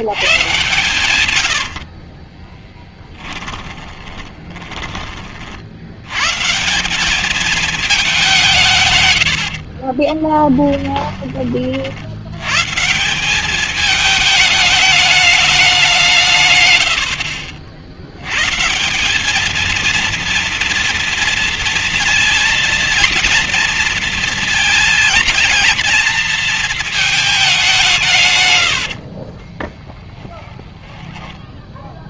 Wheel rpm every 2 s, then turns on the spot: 130, 40, 20, 130, 180, 20, 90, 220, 150, 110, 230, 230, 220, 230, 130, 10.
2-6 10-12 28-30